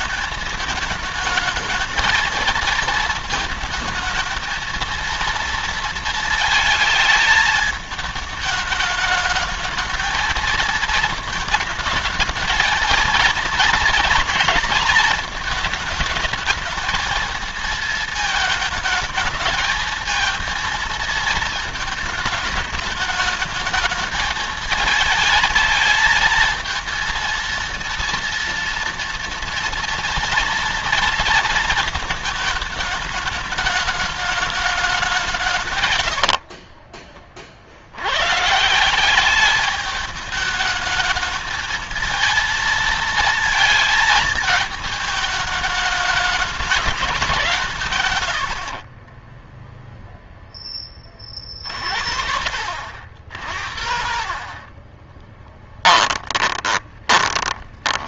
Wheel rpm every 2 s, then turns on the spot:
220, 220, 230, 220, 220, 230, 230, 230, 220, 220, 220, 210, 220, 220, 230, 230, 220, 210, 60, 150, 210, 230, 220, 210, 100, 10, 80, 40, 20.
36-38 48-50 54-58